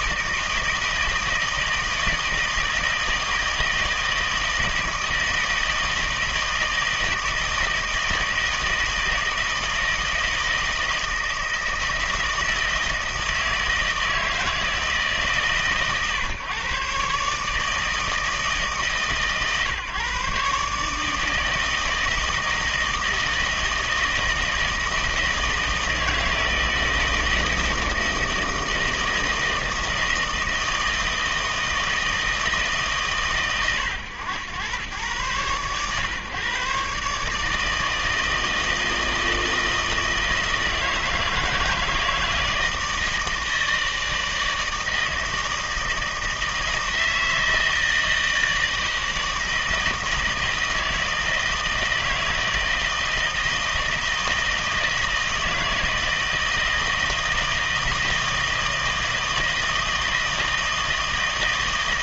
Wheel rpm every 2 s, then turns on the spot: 160, 160, 160, 160, 160, 160, 160, 160, 130, 150, 150, 160, 160, 160, 160, 160, 150, 100, 130, 160, 160, 160, 160, 160, 160, 160, 160, 160, 160, 160, 160.
none